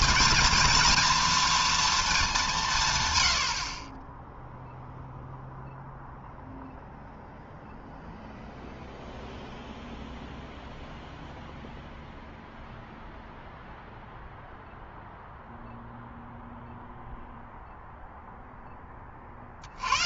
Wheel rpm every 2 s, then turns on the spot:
230, 200, 0, 0, 0, 0, 0, 0, 0, 0.
none